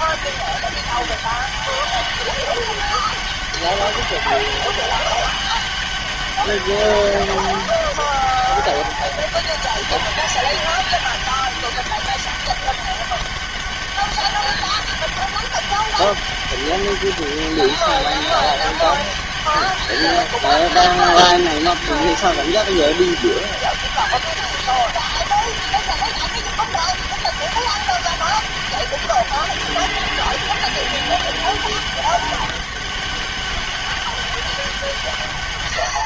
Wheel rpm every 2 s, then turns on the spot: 200, 200, 200, 200, 200, 200, 200, 200, 200, 200, 200, 200, 200, 200, 200, 200, 200, 180.
none